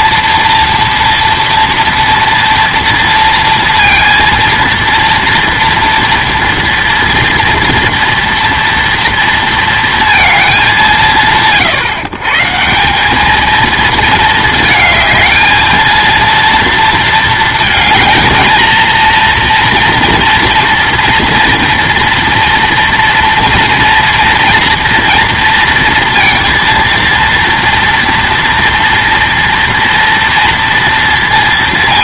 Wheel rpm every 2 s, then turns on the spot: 230, 230, 230, 230, 230, 190, 160, 220, 230, 220, 230, 230, 230, 230, 240, 230.
none